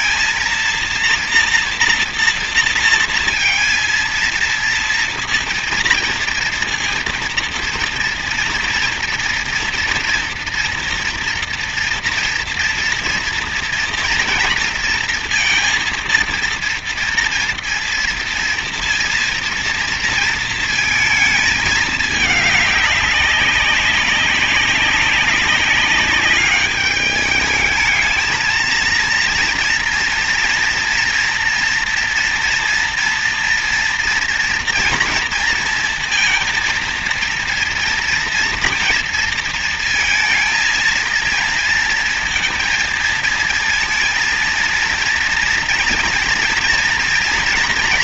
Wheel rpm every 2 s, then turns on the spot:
230, 230, 230, 230, 230, 240, 230, 230, 230, 230, 220, 200, 190, 210, 230, 230, 240, 230, 230, 230, 230, 230, 230, 230.
none